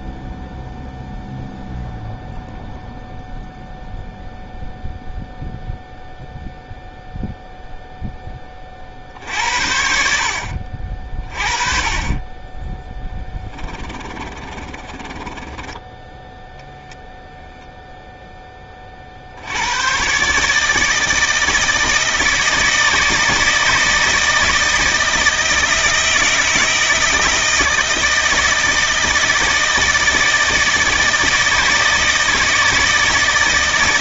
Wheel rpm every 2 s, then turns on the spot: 0, 0, 0, 0, 30, 50, 10, 20, 0, 20, 150, 160, 160, 160, 160, 160, 160.
14-16